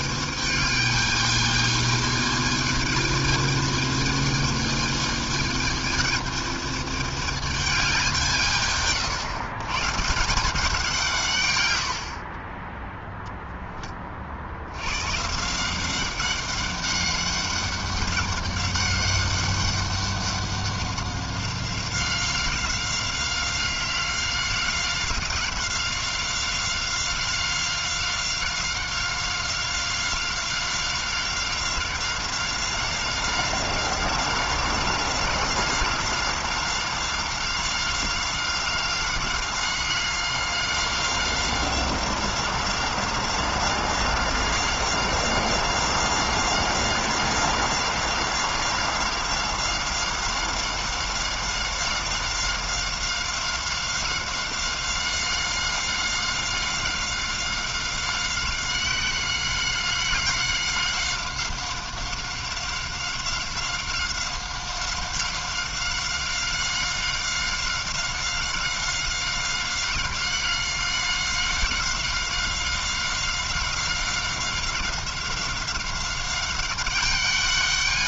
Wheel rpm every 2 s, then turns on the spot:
210, 220, 220, 210, 150, 170, 30, 80, 200, 200, 190, 180, 180, 190, 190, 190, 180, 180, 190, 180, 190, 180, 190, 190, 180, 190, 190, 190, 190, 190, 190, 190, 190, 190, 190, 190, 190, 190, 190.
none